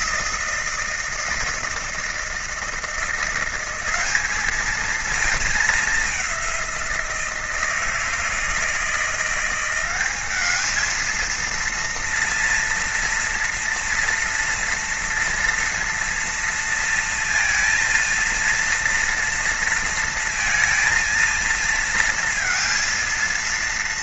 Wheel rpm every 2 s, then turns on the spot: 160, 170, 210, 180, 160, 220, 230, 240, 230, 230, 220, 230.
none